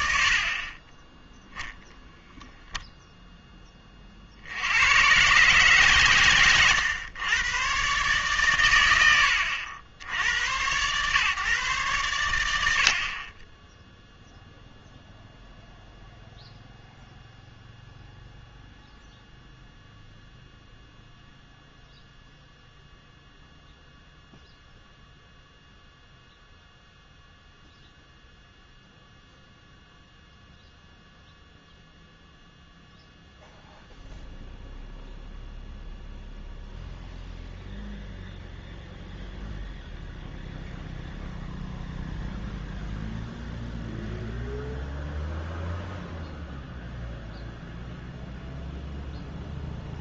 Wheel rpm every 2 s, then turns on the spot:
50, 0, 90, 120, 110, 120, 90, 0, 0, 0, 0, 0, 0, 0, 0, 0, 0, 0, 0, 0, 0, 0, 0, 0, 0.
none